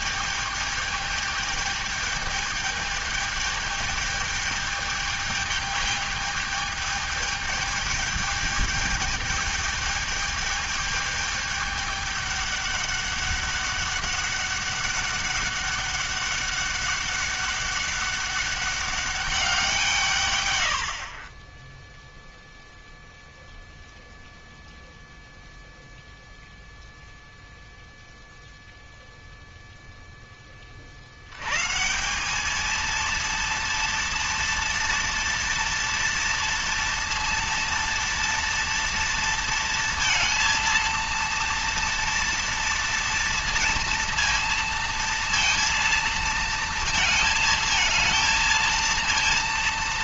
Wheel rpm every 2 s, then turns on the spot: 210, 210, 210, 210, 210, 210, 200, 200, 200, 200, 90, 0, 0, 0, 0, 40, 220, 230, 230, 230, 230, 230, 230, 230, 230.
none